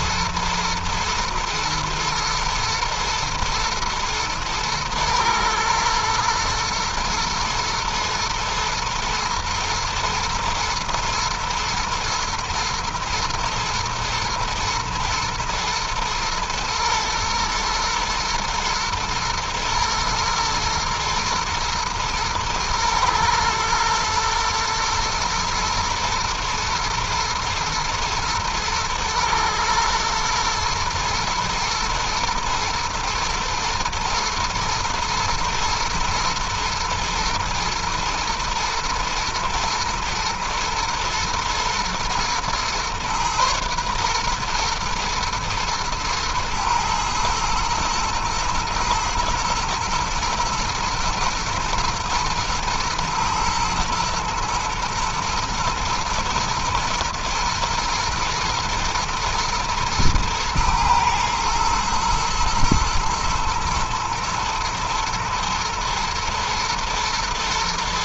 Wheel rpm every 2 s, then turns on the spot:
120, 110, 110, 120, 120, 110, 120, 110, 120, 110, 120, 110, 110, 120, 110, 110, 120, 110, 120, 110, 110, 120, 120, 110, 120, 110, 110, 120, 110, 120, 120, 110, 110, 110.
none